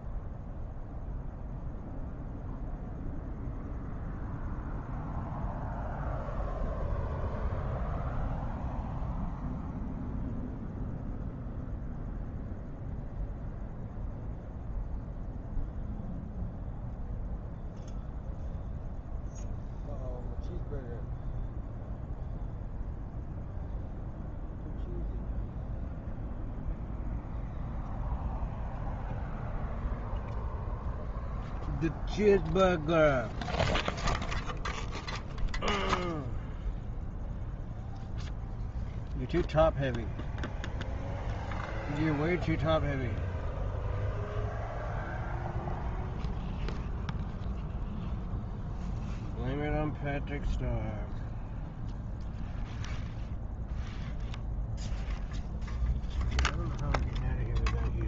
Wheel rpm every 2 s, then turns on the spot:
0, 0, 0, 0, 0, 0, 0, 0, 0, 0, 0, 0, 0, 0, 0, 0, 0, 0, 0, 0, 0, 0, 0, 0, 0, 0, 0, 0, 0.
none